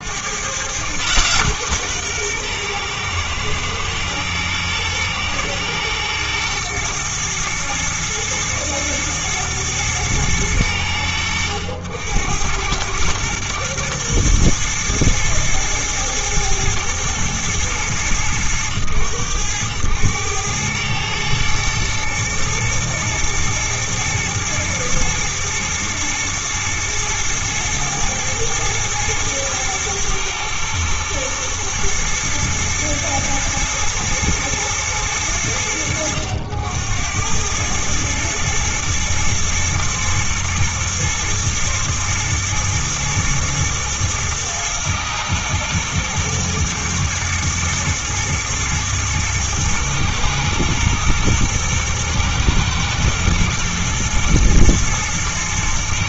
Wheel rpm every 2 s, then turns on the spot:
130, 120, 110, 120, 110, 90, 110, 110, 110, 100, 110, 110, 120, 120, 110, 120, 110, 100, 90, 120, 110, 110, 110, 110, 110, 120, 120, 120.
none